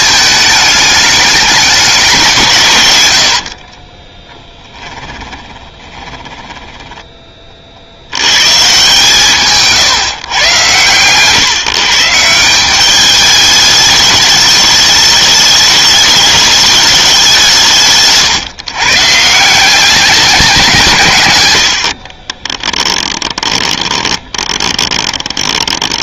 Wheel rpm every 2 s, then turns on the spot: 210, 130, 10, 10, 140, 120, 190, 210, 210, 140, 170, 20, 20.
2-8 22-26